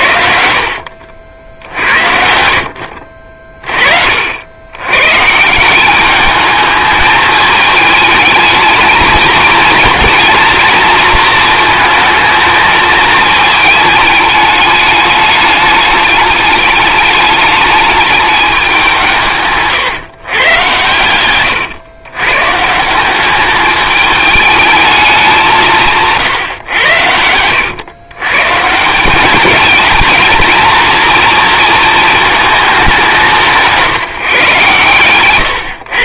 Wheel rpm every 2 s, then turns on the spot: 70, 60, 90, 210, 220, 230, 220, 210, 210, 180, 110, 150, 210, 110, 160, 220, 200, 130.
0-2